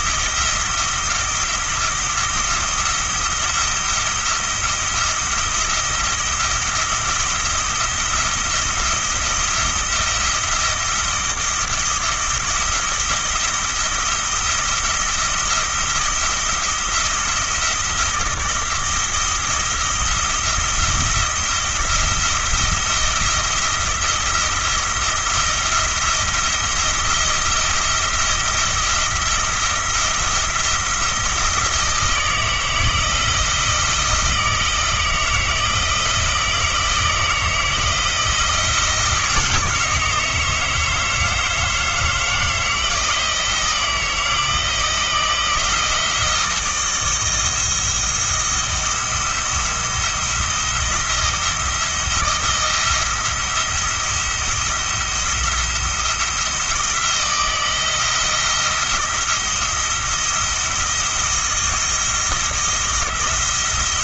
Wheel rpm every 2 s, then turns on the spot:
170, 170, 170, 170, 170, 170, 170, 170, 170, 170, 170, 170, 170, 170, 170, 170, 160, 160, 170, 160, 160, 160, 170, 160, 170, 170, 170, 170, 170, 170, 170, 170.
none